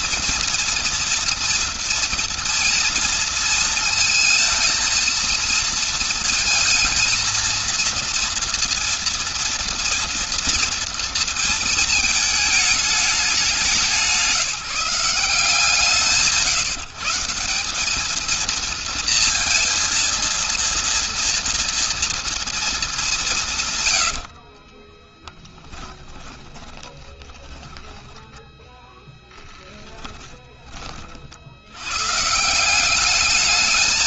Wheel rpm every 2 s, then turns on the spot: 230, 230, 220, 220, 230, 230, 220, 180, 150, 230, 230, 230, 40, 10, 10, 20, 140.
24-30